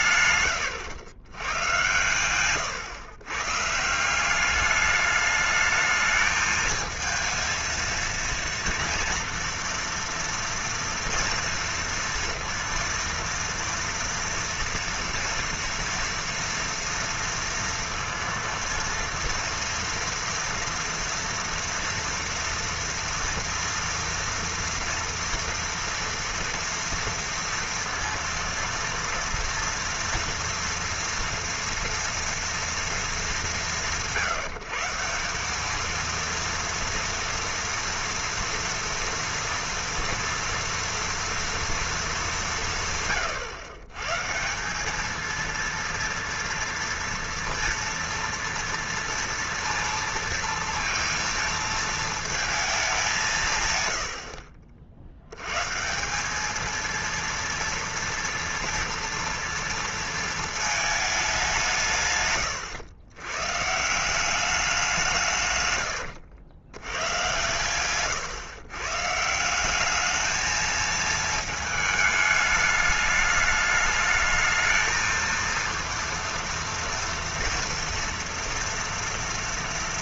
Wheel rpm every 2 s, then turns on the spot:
100, 120, 200, 220, 230, 230, 230, 230, 230, 230, 230, 230, 230, 230, 230, 230, 230, 160, 230, 230, 230, 160, 180, 230, 230, 230, 220, 50, 220, 230, 220, 110, 190, 90, 120, 220, 210, 220, 230, 230.
none